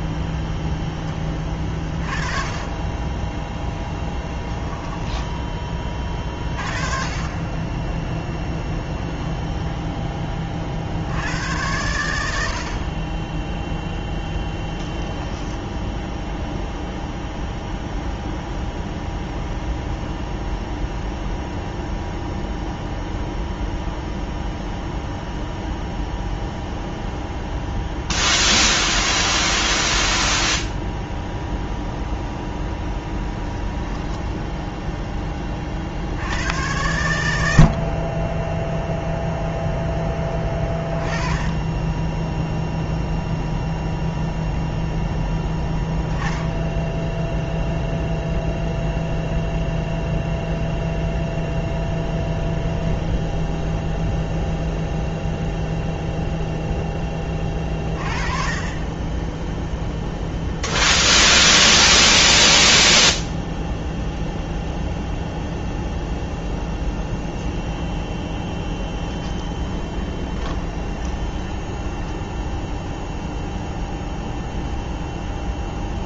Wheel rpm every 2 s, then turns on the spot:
10, 30, 10, 30, 0, 20, 70, 0, 0, 0, 0, 0, 0, 0, 0, 0, 0, 0, 80, 10, 10, 0, 0, 20, 0, 0, 0, 0, 0, 30, 0, 10, 0, 0, 10, 20, 10, 0.
4-6 62-64 68-72